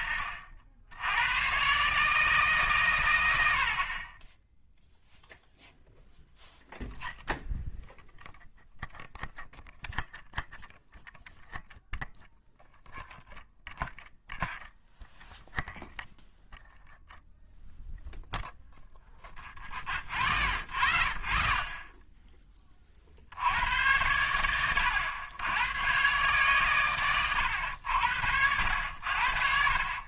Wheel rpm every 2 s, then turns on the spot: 70, 130, 0, 0, 0, 0, 0, 0, 0, 0, 0, 40, 100, 120, 80.
none